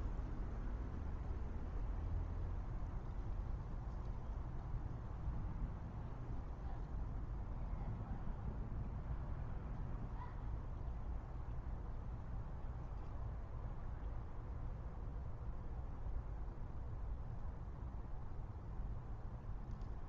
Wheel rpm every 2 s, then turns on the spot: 0, 0, 0, 0, 0, 0, 0, 0, 0, 0.
none